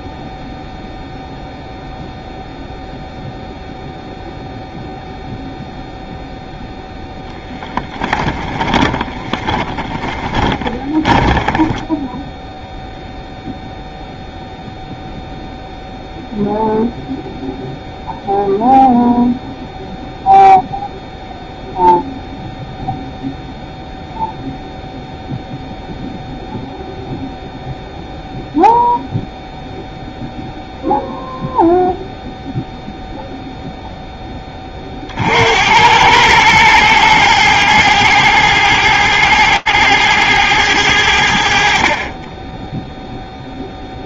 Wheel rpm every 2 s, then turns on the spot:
0, 0, 0, 0, 20, 20, 0, 0, 0, 0, 0, 0, 0, 0, 0, 0, 0, 30, 110, 110, 90, 0.
8-12